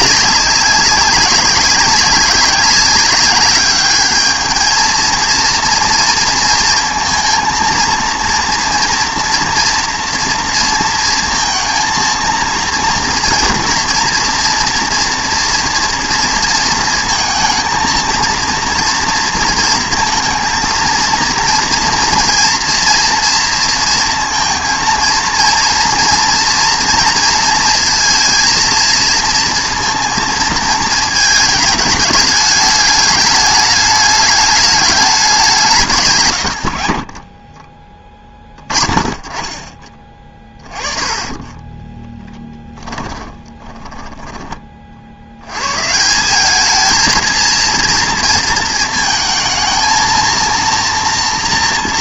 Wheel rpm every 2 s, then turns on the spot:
200, 190, 220, 230, 230, 230, 230, 230, 230, 230, 230, 230, 230, 230, 220, 220, 210, 210, 70, 20, 20, 10, 30, 220, 230, 230.
42-44